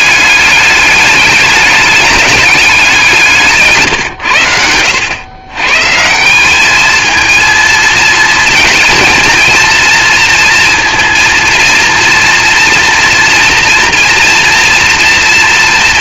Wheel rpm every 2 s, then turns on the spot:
210, 200, 100, 200, 220, 230, 230, 230.
none